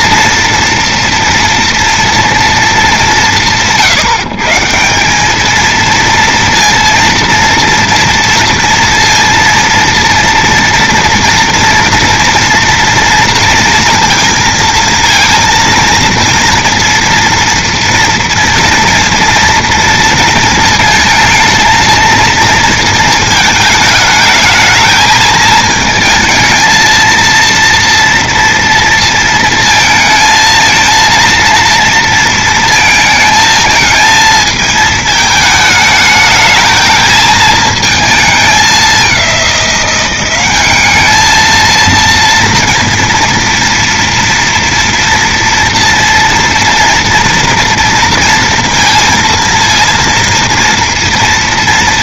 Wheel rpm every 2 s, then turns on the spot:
230, 230, 140, 230, 230, 230, 230, 230, 230, 230, 230, 230, 220, 220, 230, 230, 230, 220, 220, 220, 190, 230, 230, 230, 230, 230.
none